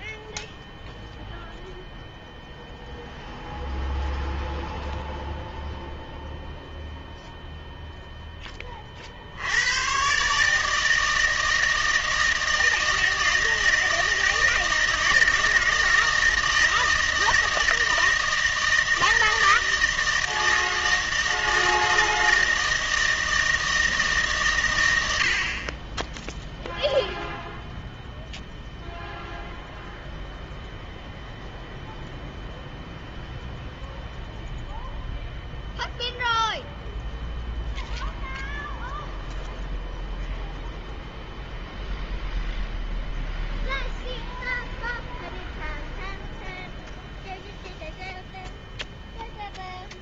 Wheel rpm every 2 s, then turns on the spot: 0, 0, 0, 0, 30, 160, 160, 160, 160, 160, 160, 160, 110, 0, 0, 0, 0, 0, 0, 0, 0, 0, 0, 0, 0.
none